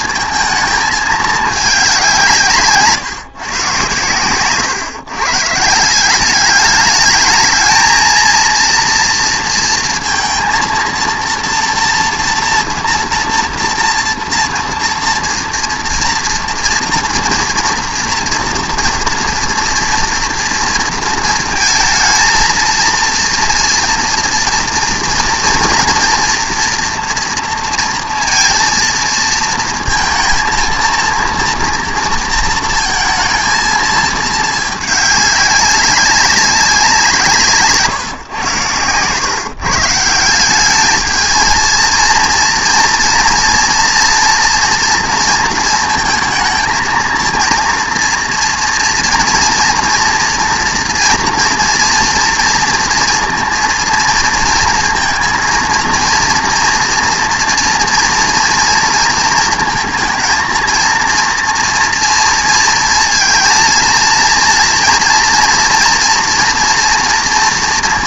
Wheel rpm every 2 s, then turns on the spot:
220, 150, 130, 200, 230, 230, 230, 240, 230, 230, 230, 230, 230, 230, 230, 230, 230, 220, 190, 120, 190, 230, 230, 220, 240, 230, 230, 230, 240, 240, 230, 230, 230, 240.
none